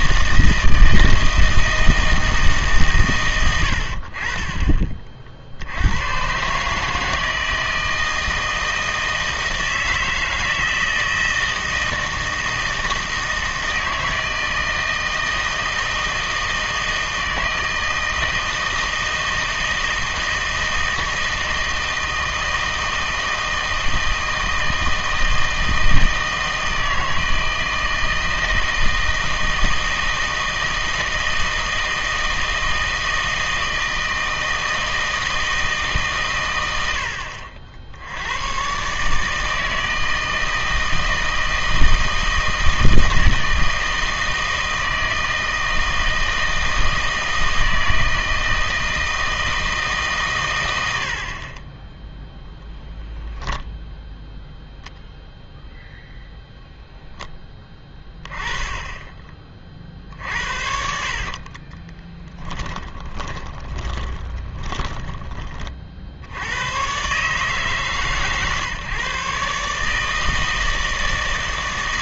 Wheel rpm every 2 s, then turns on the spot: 160, 150, 30, 150, 160, 160, 160, 160, 160, 160, 160, 160, 160, 160, 160, 160, 160, 160, 100, 130, 160, 160, 160, 160, 160, 100, 0, 0, 0, 10, 60, 20, 10, 110, 140, 160.
60-66